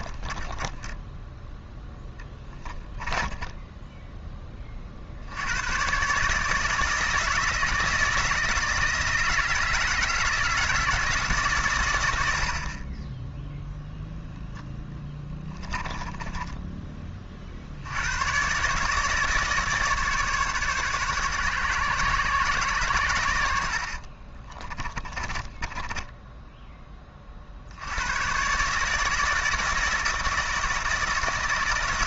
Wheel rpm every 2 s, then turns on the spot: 10, 10, 20, 150, 160, 160, 60, 10, 10, 140, 140, 120, 30, 10, 140, 160.
0-4 12-14 16-18 24-26